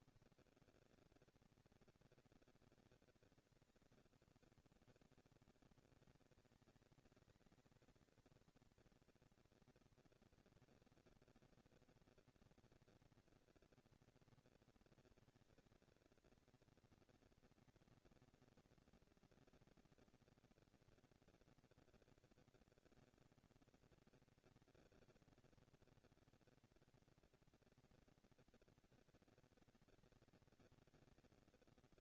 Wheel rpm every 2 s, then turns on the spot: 190, 200, 150, 210, 230, 230, 230, 240, 230, 230, 230, 230, 230, 230, 240, 230.
none